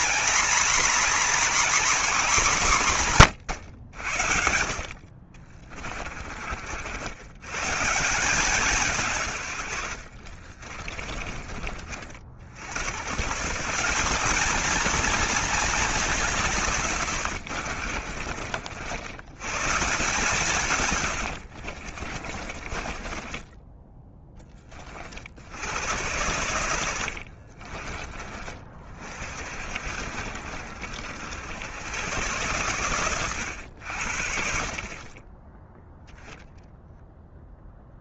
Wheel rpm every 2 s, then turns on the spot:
250, 210, 60, 60, 180, 40, 80, 220, 160, 70, 150, 30, 20, 90, 30, 60, 110, 40, 0.
10-12 22-24 26-28